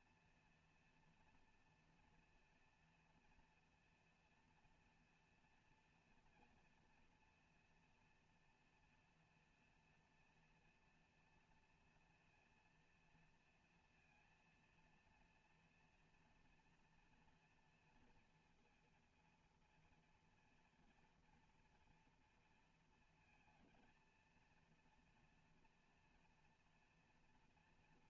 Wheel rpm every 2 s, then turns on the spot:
230, 230, 230, 230, 230, 240, 230, 230, 230, 230, 230, 230, 230, 230.
none